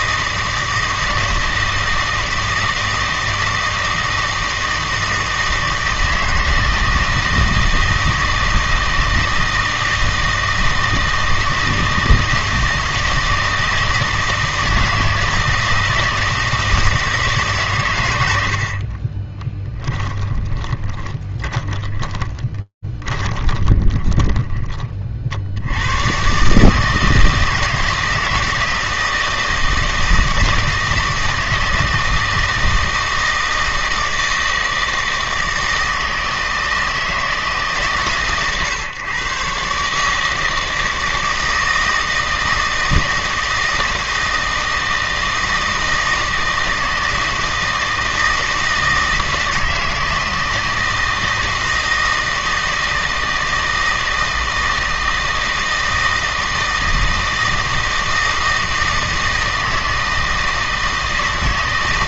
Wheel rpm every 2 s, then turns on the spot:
160, 160, 160, 160, 160, 160, 160, 160, 160, 50, 30, 20, 40, 160, 160, 160, 160, 160, 160, 120, 160, 160, 160, 160, 160, 160, 160, 160, 160, 160, 160.
18-24